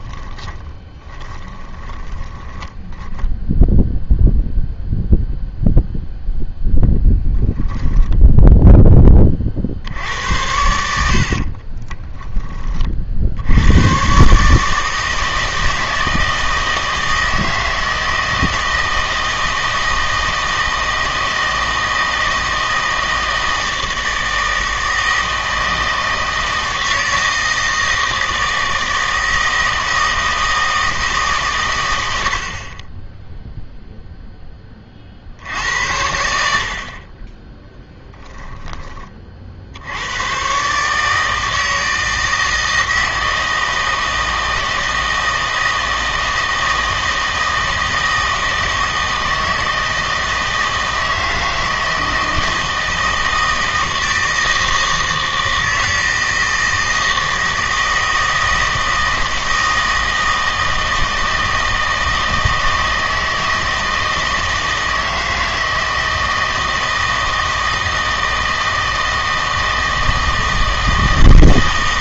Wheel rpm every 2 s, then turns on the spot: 30, 20, 0, 10, 10, 80, 30, 150, 160, 160, 160, 160, 160, 160, 160, 160, 40, 10, 60, 20, 140, 160, 160, 160, 160, 160, 160, 160, 160, 160, 160, 160, 160, 160, 160, 160.
0-4 6-10